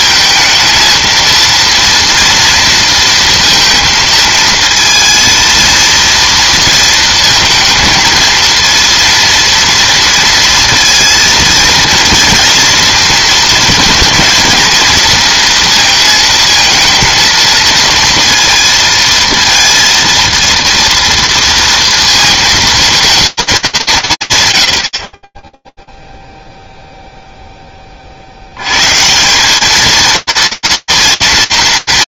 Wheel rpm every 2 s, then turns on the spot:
230, 230, 230, 230, 230, 230, 230, 220, 220, 230, 230, 220, 90, 0, 130, 230.
none